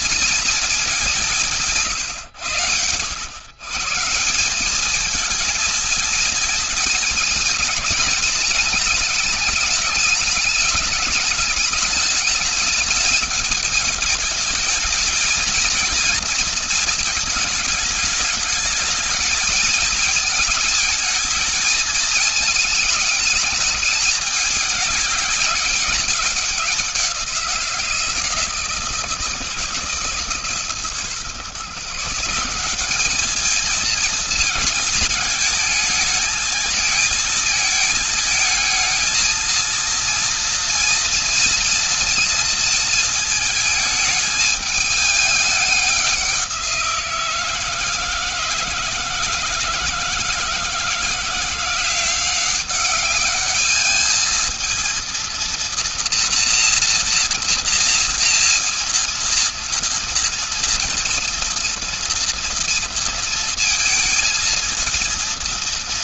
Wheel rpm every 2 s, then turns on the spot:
220, 120, 180, 220, 210, 200, 210, 220, 230, 220, 220, 220, 210, 190, 160, 150, 180, 230, 220, 220, 230, 230, 220, 180, 160, 160, 190, 220, 240, 230, 230, 230, 230.
none